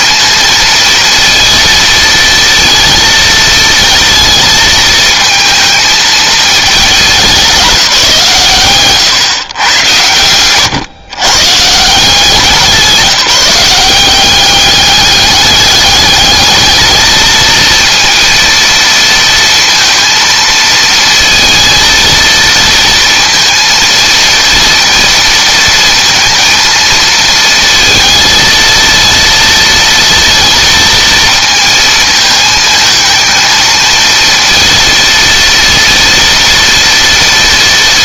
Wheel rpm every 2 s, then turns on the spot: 230, 230, 220, 210, 120, 120, 170, 200, 220, 230, 230, 230, 230, 230, 230, 230, 220, 230, 230.
none